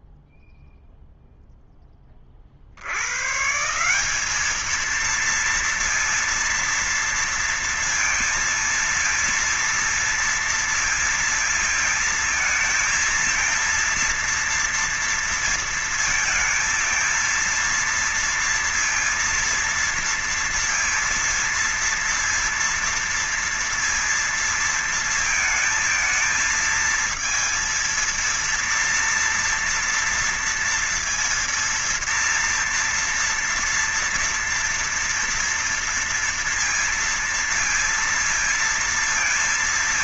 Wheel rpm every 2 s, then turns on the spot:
0, 30, 190, 230, 230, 230, 220, 230, 230, 230, 230, 230, 230, 230, 230, 230, 230, 230, 230, 230.
none